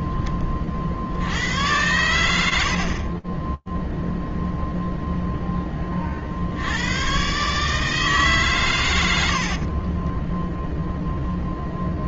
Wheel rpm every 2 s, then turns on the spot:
10, 90, 0, 50, 130, 10.
10-12